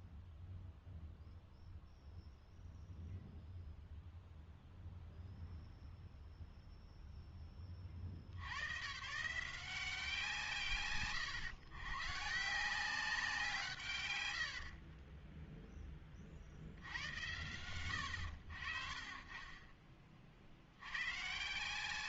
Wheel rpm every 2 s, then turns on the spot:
0, 0, 0, 0, 110, 110, 180, 40, 50, 30, 60.
14-16